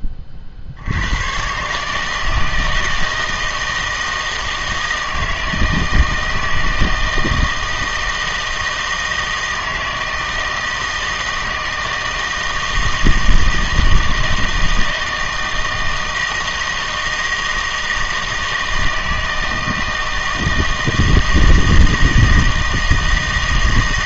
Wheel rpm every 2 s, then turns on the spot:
70, 160, 160, 160, 160, 160, 160, 160, 160, 160, 160, 160.
none